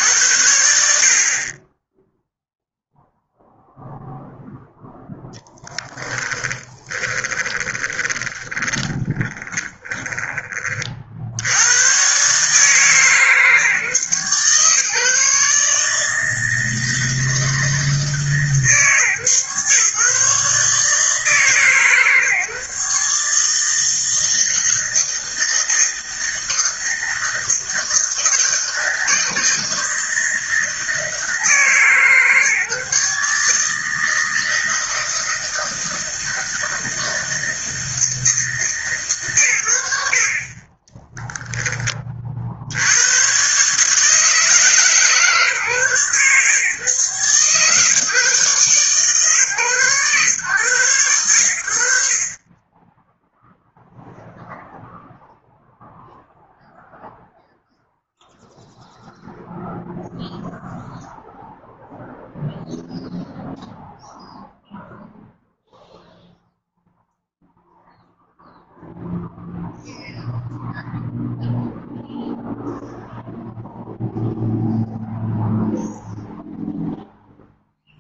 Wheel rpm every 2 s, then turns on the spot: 60, 0, 0, 20, 20, 30, 150, 140, 160, 140, 150, 150, 160, 160, 160, 160, 150, 160, 160, 130, 10, 80, 140, 130, 140, 110, 10, 0, 0, 0, 0, 0, 0, 0, 0, 0, 0, 0, 0.
6-10 40-42